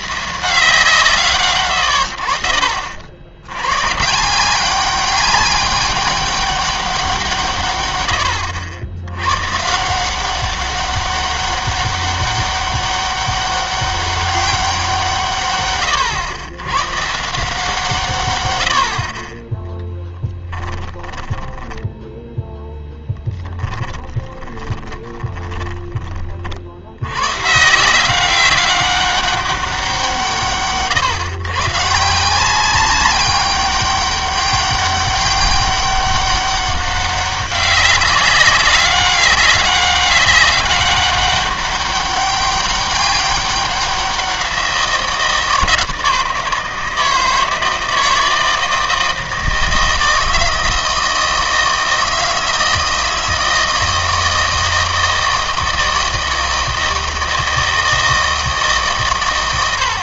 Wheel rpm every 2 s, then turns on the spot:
160, 50, 190, 200, 80, 190, 200, 180, 110, 90, 10, 0, 20, 60, 200, 140, 190, 200, 200, 200, 200, 200, 170, 160, 160, 160, 160, 160, 160, 150.
20-22 24-26